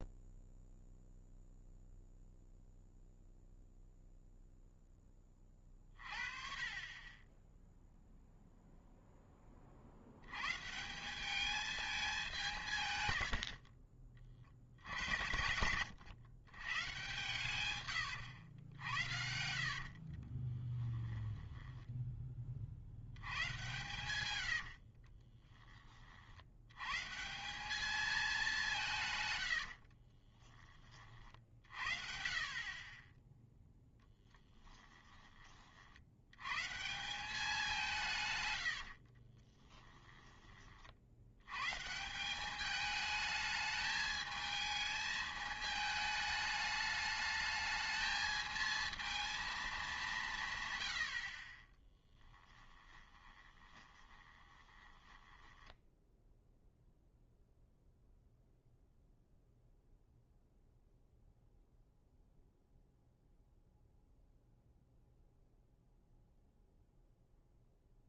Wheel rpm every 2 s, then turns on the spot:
0, 0, 0, 30, 0, 140, 170, 70, 120, 90, 20, 40, 80, 100, 180, 20, 40, 10, 130, 110, 30, 200, 220, 210, 220, 130, 20, 20, 0, 0, 0, 0, 0, 0.
20-22 24-26 34-36 38-40 52-56